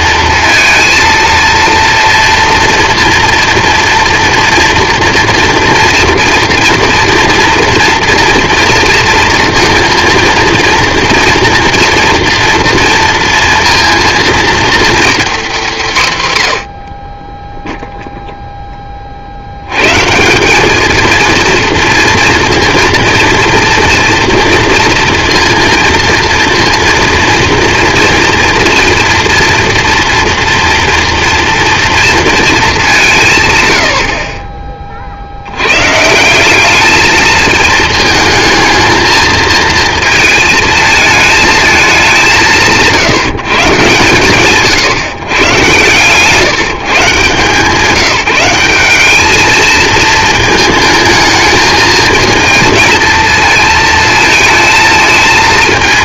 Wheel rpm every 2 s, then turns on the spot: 230, 230, 230, 230, 230, 230, 230, 240, 100, 10, 200, 230, 230, 230, 230, 230, 220, 30, 190, 220, 220, 170, 130, 160, 180, 220, 230, 220.
none